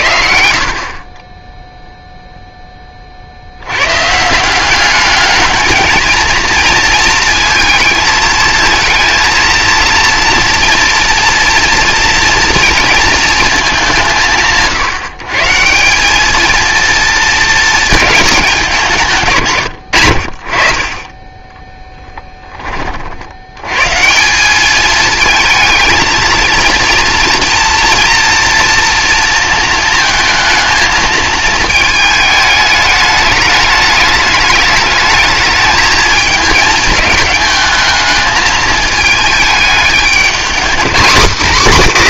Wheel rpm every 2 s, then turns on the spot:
50, 10, 180, 230, 220, 240, 230, 150, 220, 200, 50, 20, 200, 230, 230, 220, 210, 210, 220, 220, 230.
none